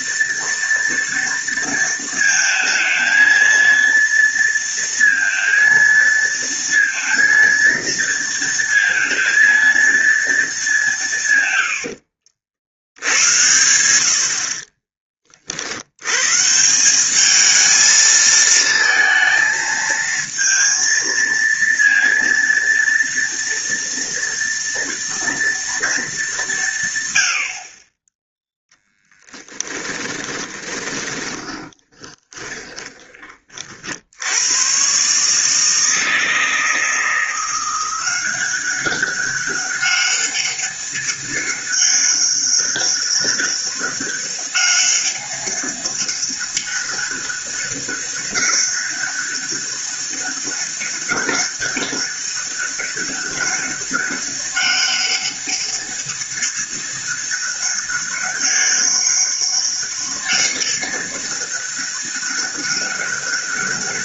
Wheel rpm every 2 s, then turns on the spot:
230, 220, 230, 230, 230, 190, 80, 40, 180, 220, 230, 230, 230, 150, 10, 30, 20, 130, 160, 190, 200, 200, 200, 200, 200, 200, 200, 200, 200, 200, 200, 200.
14-16 30-34